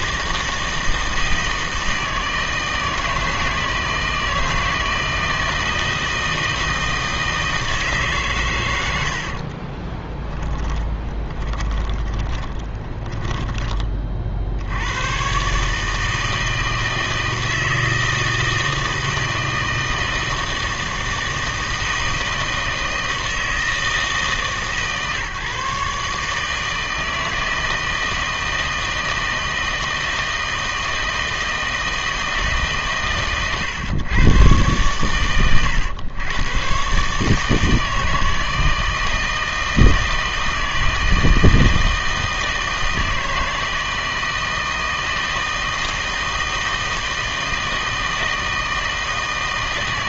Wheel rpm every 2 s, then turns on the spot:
160, 160, 160, 160, 90, 20, 20, 100, 160, 160, 160, 160, 150, 160, 160, 160, 140, 120, 120, 160, 160, 160, 160, 160, 160.
10-14